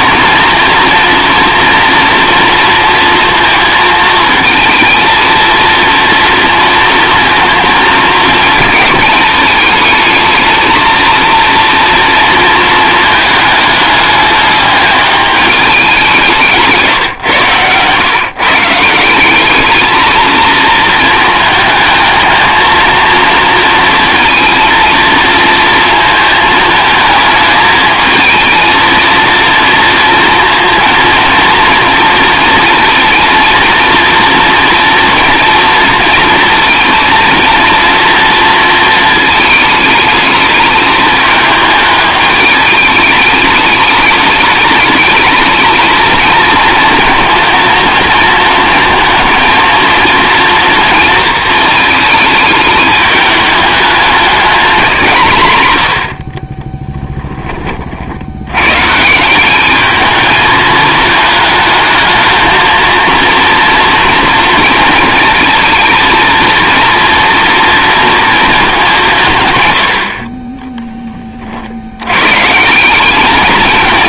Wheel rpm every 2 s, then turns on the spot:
230, 230, 220, 230, 220, 230, 230, 210, 160, 160, 220, 230, 230, 220, 230, 230, 230, 240, 230, 230, 220, 210, 210, 230, 230, 230, 220, 200, 20, 130, 220, 230, 230, 230, 200, 20, 170.
56-58